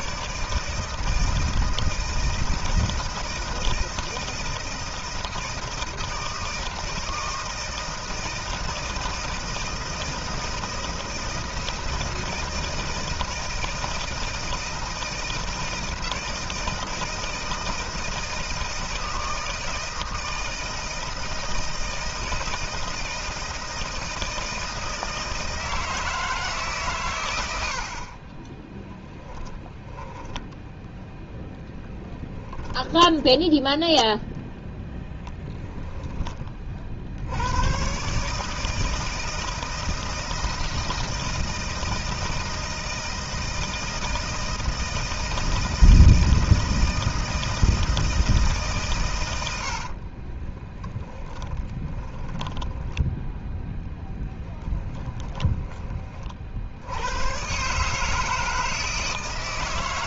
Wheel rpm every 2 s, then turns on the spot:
160, 160, 160, 160, 160, 160, 160, 160, 160, 160, 160, 160, 160, 130, 20, 10, 20, 0, 40, 150, 160, 160, 160, 160, 140, 20, 10, 20, 70, 160.
28-34 50-52 54-56